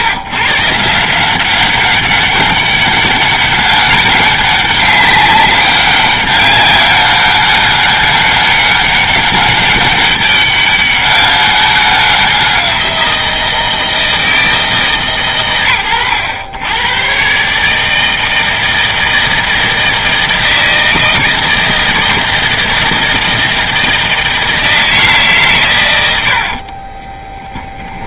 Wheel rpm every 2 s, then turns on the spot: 140, 200, 200, 200, 200, 200, 180, 150, 110, 160, 160, 160, 160, 30.
26-28